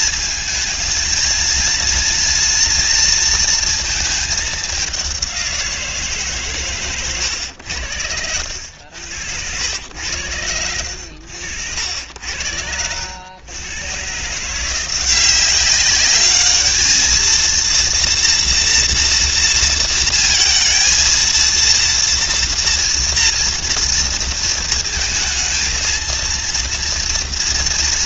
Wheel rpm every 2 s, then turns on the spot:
220, 230, 210, 140, 80, 90, 80, 160, 210, 240, 230, 230, 230, 230.
none